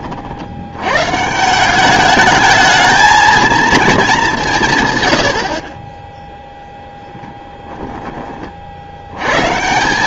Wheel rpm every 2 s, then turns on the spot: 90, 220, 130, 0, 50.
none